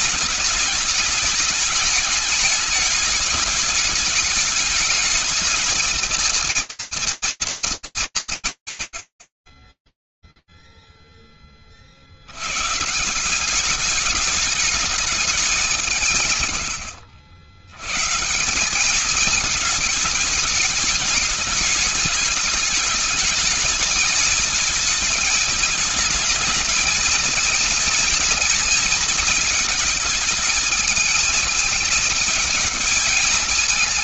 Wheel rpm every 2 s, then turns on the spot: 210, 210, 220, 230, 110, 0, 120, 210, 110, 190, 210, 210, 220, 220, 220, 220, 220.
none